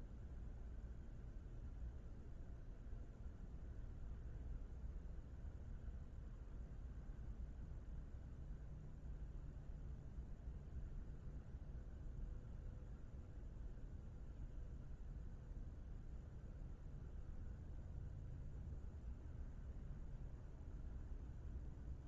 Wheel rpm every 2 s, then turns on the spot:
0, 0, 0, 0, 0, 0, 0, 0, 0, 0, 0.
none